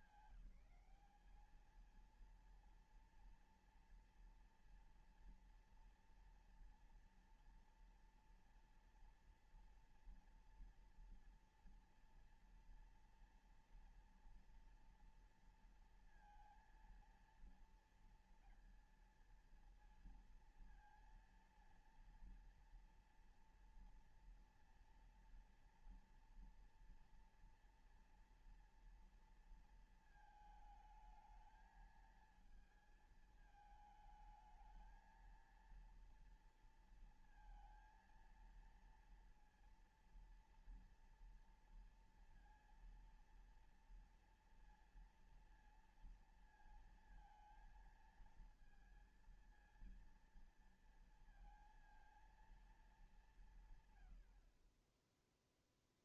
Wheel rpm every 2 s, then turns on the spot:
200, 230, 230, 230, 230, 230, 230, 230, 230, 230, 230, 230, 230, 230, 230, 220, 220, 220, 230, 230, 230, 230, 230, 230, 220, 230, 230, 90.
none